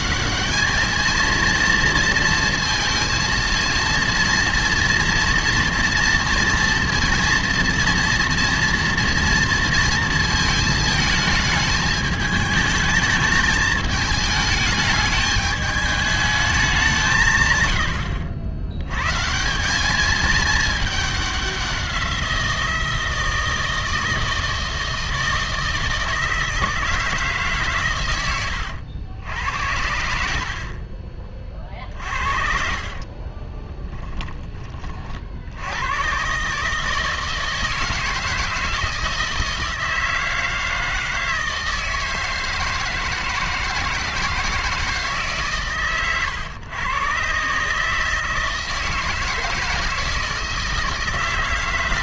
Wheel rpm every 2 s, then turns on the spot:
220, 230, 230, 230, 230, 220, 210, 220, 210, 80, 210, 170, 160, 160, 80, 50, 50, 20, 150, 160, 160, 160, 160, 120, 160, 160.
32-34